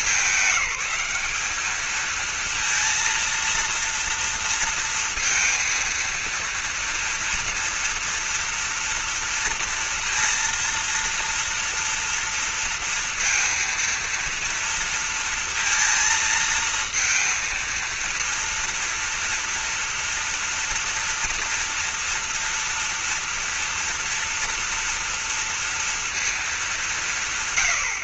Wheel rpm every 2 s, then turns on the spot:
190, 230, 230, 230, 230, 230, 230, 230, 220, 230, 240, 230, 230, 200.
none